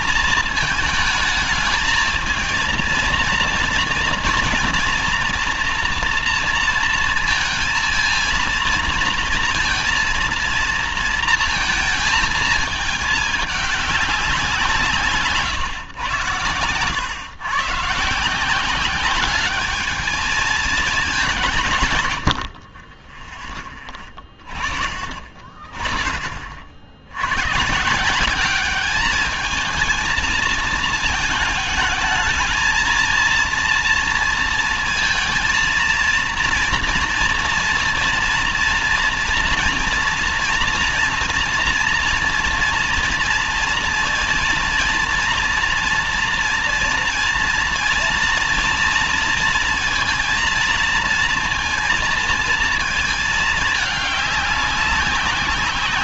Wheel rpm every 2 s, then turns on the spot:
220, 230, 230, 230, 230, 230, 220, 170, 100, 180, 210, 50, 30, 50, 200, 220, 220, 230, 230, 230, 230, 230, 230, 230, 230, 230, 230, 200.
none